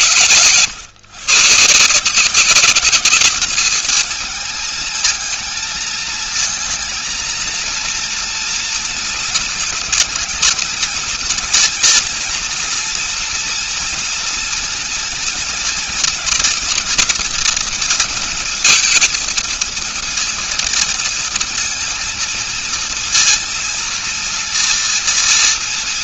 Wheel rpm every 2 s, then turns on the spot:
130, 190, 220, 220, 240, 220, 230, 230, 240, 230, 230, 230, 240.
none